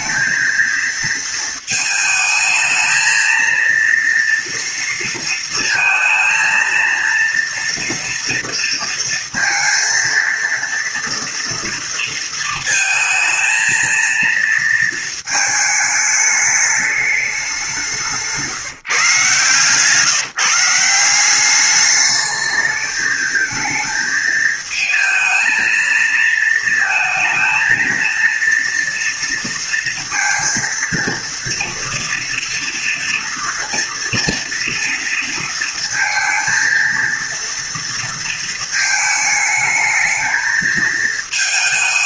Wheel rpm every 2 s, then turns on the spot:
220, 220, 230, 230, 230, 230, 230, 230, 210, 160, 160, 210, 220, 220, 230, 230, 230, 230, 230, 230, 220.
none